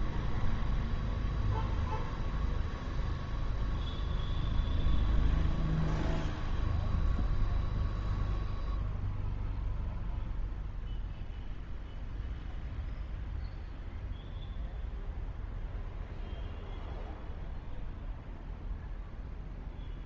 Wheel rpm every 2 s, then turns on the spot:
0, 0, 0, 0, 0, 0, 0, 0, 0, 0.
none